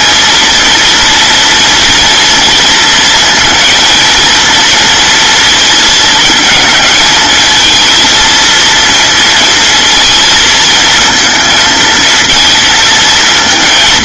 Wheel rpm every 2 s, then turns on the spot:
230, 230, 230, 220, 230, 220, 220.
none